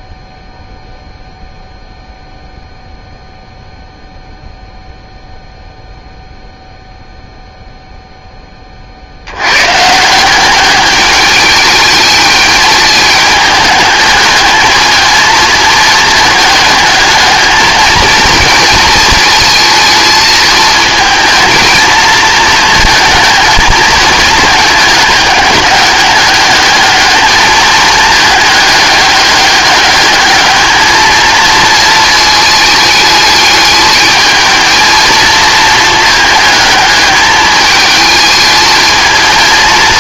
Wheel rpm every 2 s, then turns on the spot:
0, 0, 0, 0, 30, 200, 210, 220, 220, 230, 220, 230, 220, 210, 210, 220, 220, 220, 220, 220.
none